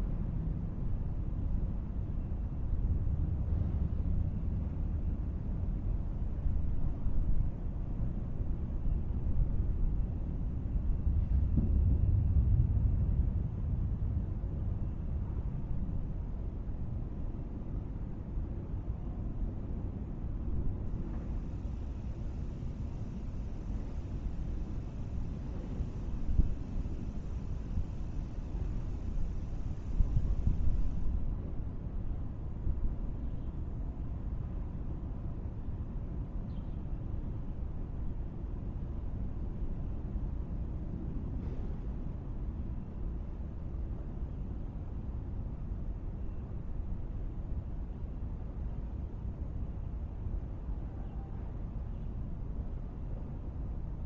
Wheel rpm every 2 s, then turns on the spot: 0, 0, 0, 0, 0, 0, 0, 0, 0, 0, 0, 0, 0, 0, 0, 0, 0, 0, 0, 0, 0, 0, 0, 0, 0, 0, 0.
none